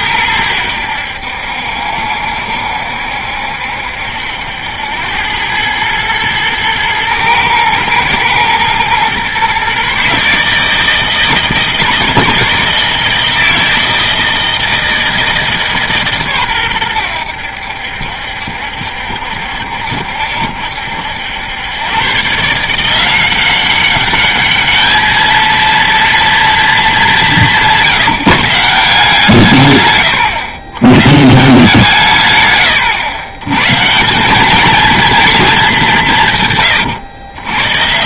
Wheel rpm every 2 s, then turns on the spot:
90, 70, 90, 110, 120, 160, 160, 160, 110, 70, 70, 170, 210, 210, 160, 100, 120, 230, 130.
none